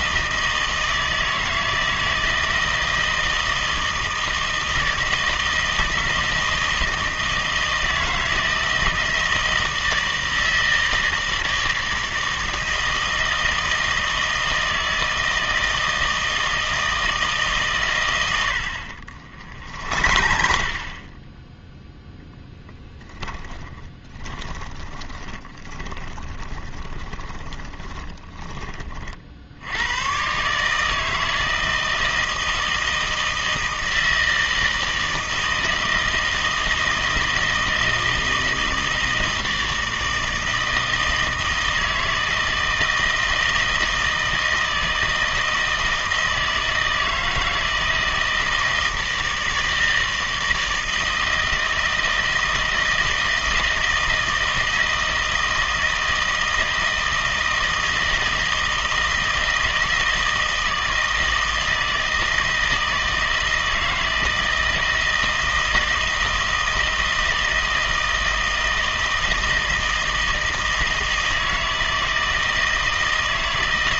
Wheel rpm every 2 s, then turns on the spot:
160, 160, 160, 160, 160, 160, 160, 160, 160, 80, 40, 10, 10, 20, 20, 150, 160, 160, 160, 160, 160, 160, 160, 160, 160, 160, 160, 160, 160, 160, 160, 160, 160, 160, 160, 160, 160.
20-22 24-28